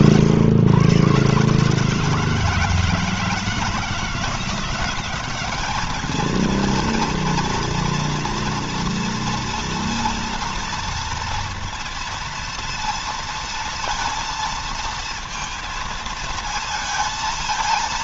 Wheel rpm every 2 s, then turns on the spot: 120, 160, 190, 230, 230, 230, 230, 230, 220.
none